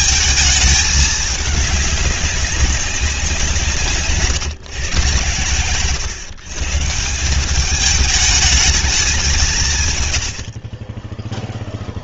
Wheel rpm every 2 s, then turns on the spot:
220, 200, 130, 140, 220, 50.
none